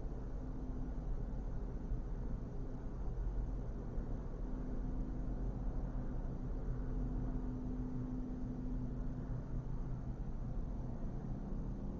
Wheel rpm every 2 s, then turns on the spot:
0, 0, 0, 0, 0, 0.
none